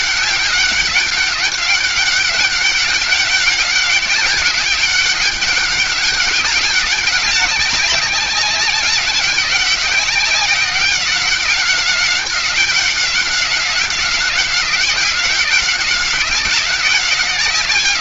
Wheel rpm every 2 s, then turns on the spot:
190, 200, 200, 200, 200, 190, 190, 190, 190.
none